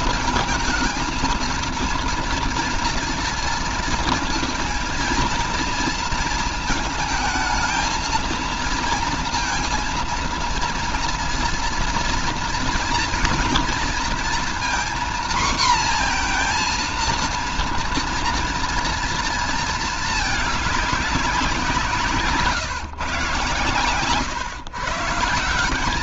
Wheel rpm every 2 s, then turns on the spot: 230, 230, 230, 230, 230, 230, 240, 240, 240, 230, 210, 150, 120.
none